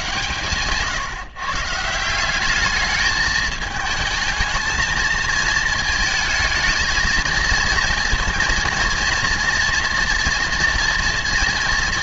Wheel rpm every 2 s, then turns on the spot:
140, 210, 220, 220, 230, 230.
none